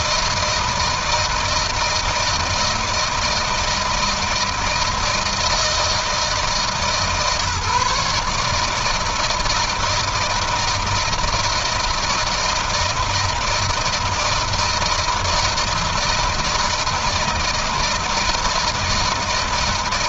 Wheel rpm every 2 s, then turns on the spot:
160, 160, 160, 160, 150, 160, 160, 160, 160, 160.
none